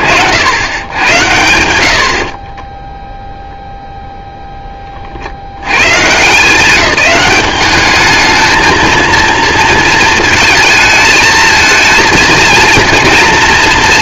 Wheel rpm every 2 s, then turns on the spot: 110, 0, 30, 190, 230, 220, 230.
none